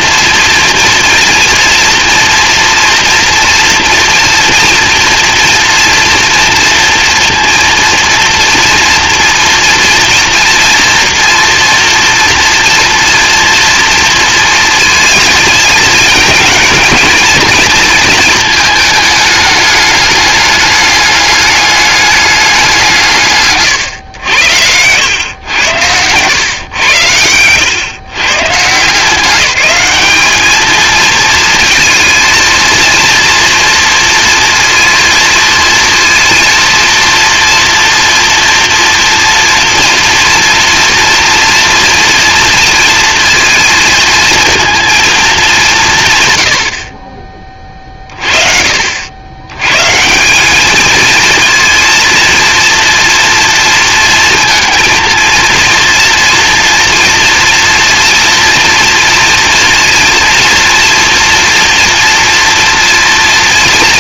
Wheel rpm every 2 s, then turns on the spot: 230, 240, 230, 230, 230, 230, 230, 230, 220, 220, 210, 190, 90, 120, 150, 220, 230, 230, 230, 240, 230, 230, 230, 100, 50, 200, 230, 230, 230, 230, 230, 240.
none